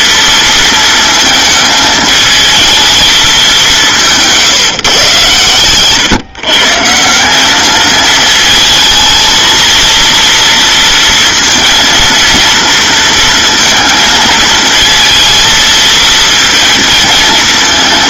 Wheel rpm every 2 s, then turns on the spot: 220, 210, 130, 180, 220, 230, 230, 230, 220.
none